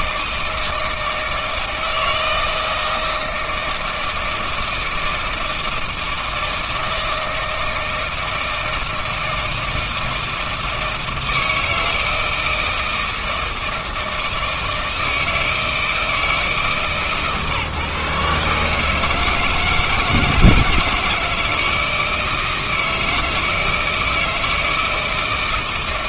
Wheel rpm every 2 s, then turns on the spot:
160, 160, 160, 160, 160, 160, 160, 160, 150, 150, 160, 160, 160.
none